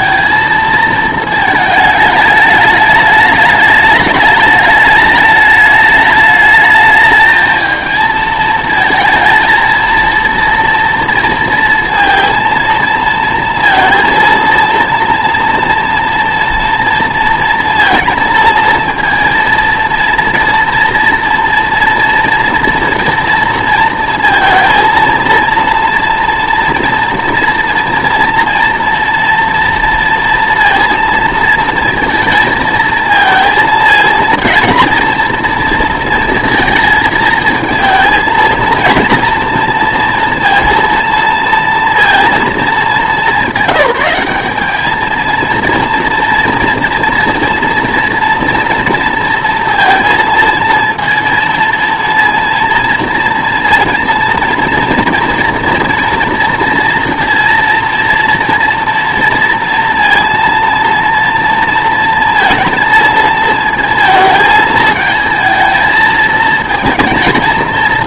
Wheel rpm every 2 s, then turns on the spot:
220, 210, 210, 210, 220, 230, 230, 230, 230, 230, 230, 240, 230, 240, 230, 230, 230, 230, 230, 230, 230, 220, 210, 230, 230, 230, 230, 240, 230, 230, 230, 230, 220, 220.
none